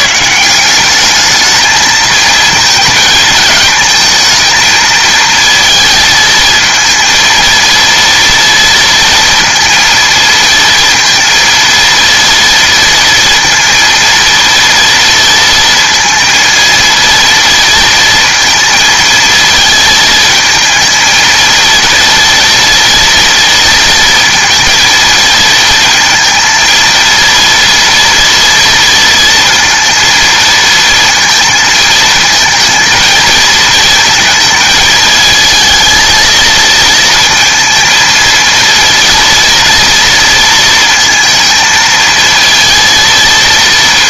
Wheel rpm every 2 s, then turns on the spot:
190, 220, 230, 230, 230, 230, 230, 230, 230, 230, 220, 230, 230, 230, 230, 230, 230, 220, 220, 230, 230, 230.
none